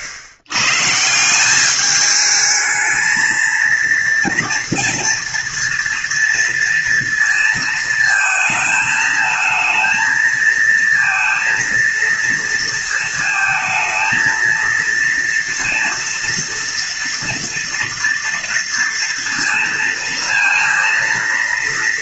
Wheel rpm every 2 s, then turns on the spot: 120, 220, 230, 230, 220, 220, 230, 230, 230, 230, 230.
none